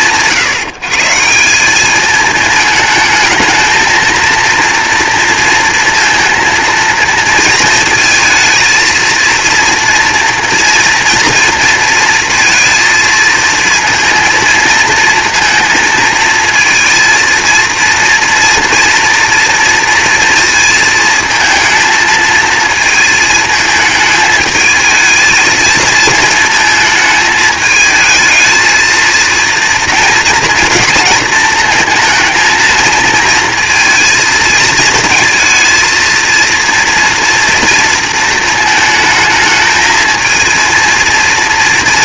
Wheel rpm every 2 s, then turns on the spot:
160, 220, 230, 230, 230, 230, 230, 230, 220, 230, 230, 220, 220, 220, 230, 230, 220, 230, 230, 220, 230.
none